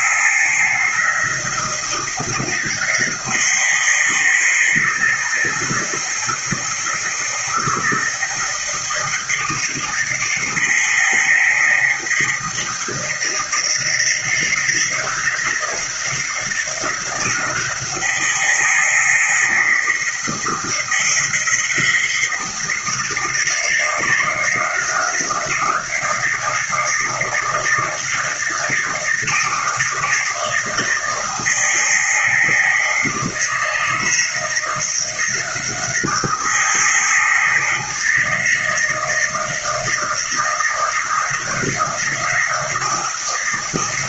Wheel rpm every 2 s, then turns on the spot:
160, 160, 160, 160, 160, 160, 160, 160, 170, 160, 160, 170, 160, 160, 160, 160, 160, 160, 160, 160, 160, 170.
none